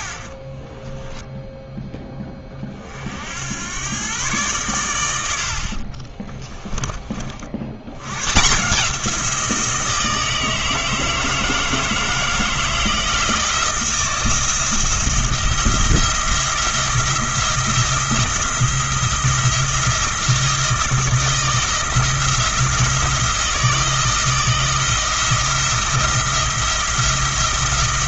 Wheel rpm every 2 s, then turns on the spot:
20, 30, 110, 20, 150, 160, 160, 170, 160, 170, 170, 170, 160, 170.
0-2 6-8